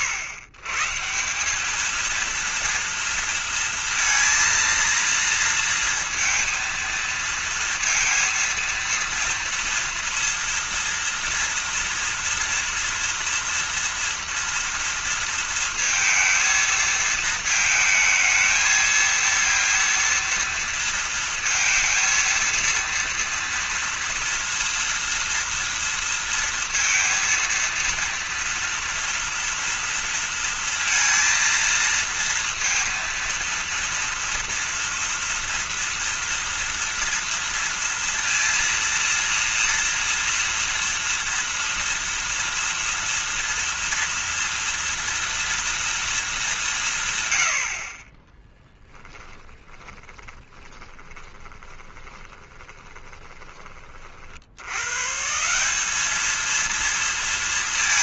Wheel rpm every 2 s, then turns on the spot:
120, 230, 230, 230, 230, 230, 230, 230, 230, 220, 230, 230, 240, 230, 230, 230, 230, 230, 230, 230, 230, 230, 230, 180, 30, 20, 20, 100, 230.
48-54